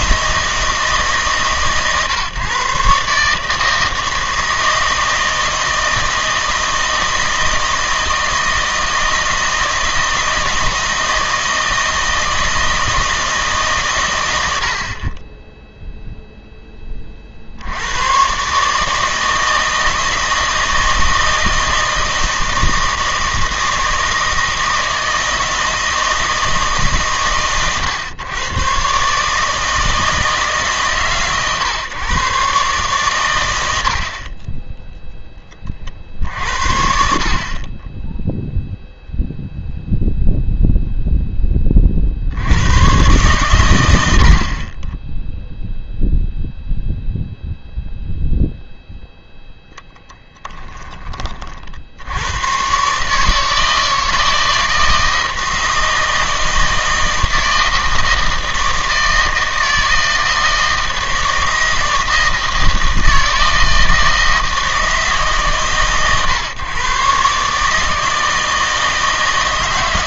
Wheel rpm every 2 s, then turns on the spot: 160, 140, 160, 160, 160, 160, 160, 60, 10, 150, 160, 160, 160, 150, 130, 140, 140, 10, 60, 0, 0, 100, 20, 0, 0, 10, 130, 160, 160, 160, 160, 160, 160, 130, 160.
50-52